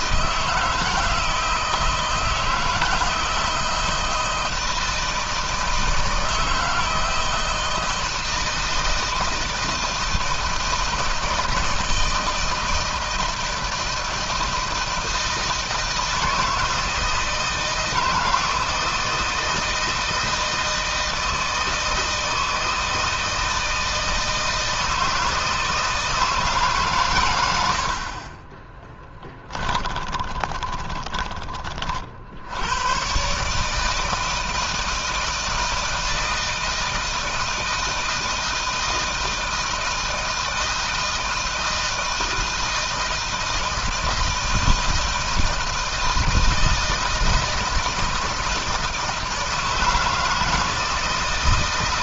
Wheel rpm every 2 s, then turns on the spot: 160, 160, 160, 160, 160, 160, 160, 160, 160, 160, 160, 160, 160, 140, 20, 20, 100, 160, 160, 160, 160, 160, 160, 160, 160, 160.
28-32